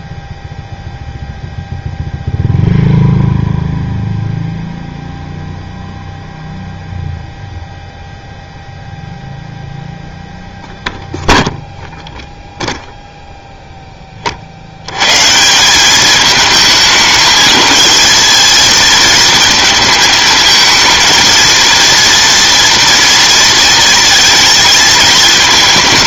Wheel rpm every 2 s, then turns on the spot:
0, 0, 0, 0, 0, 0, 0, 60, 220, 220, 220, 230, 220.
none